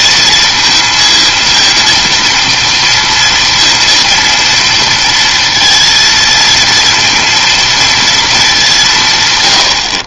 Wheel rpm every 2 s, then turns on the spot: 230, 230, 230, 230, 200.
none